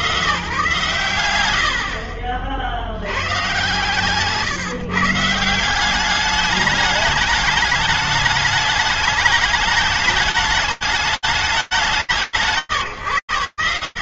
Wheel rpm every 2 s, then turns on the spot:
80, 140, 200, 210, 210, 160, 110.
none